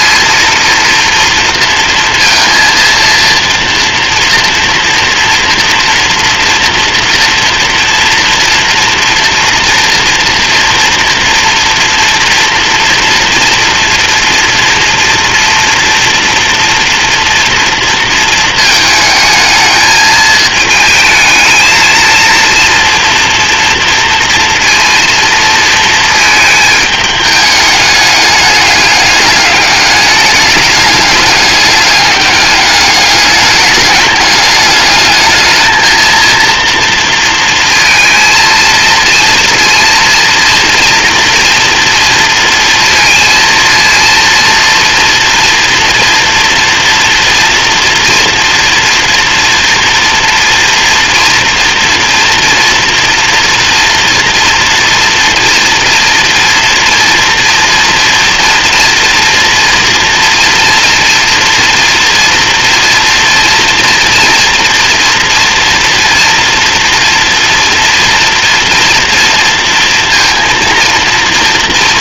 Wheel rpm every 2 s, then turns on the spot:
230, 230, 230, 230, 230, 230, 230, 230, 240, 220, 220, 230, 230, 220, 200, 210, 200, 210, 230, 230, 230, 230, 240, 230, 240, 240, 240, 240, 230, 230, 230, 230, 230, 230, 230, 230.
none